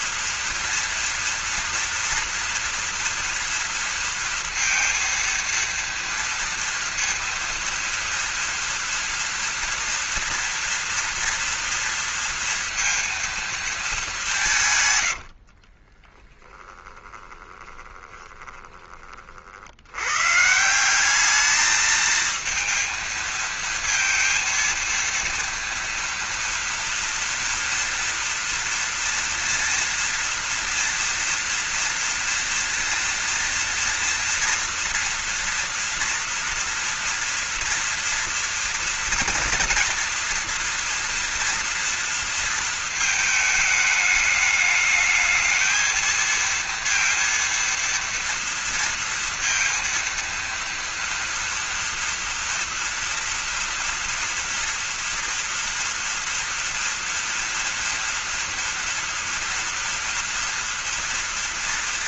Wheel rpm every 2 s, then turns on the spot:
230, 230, 230, 230, 230, 230, 230, 160, 20, 20, 150, 230, 230, 230, 230, 230, 230, 230, 230, 230, 230, 230, 210, 230, 230, 230, 230, 230, 230, 230, 230.
16-20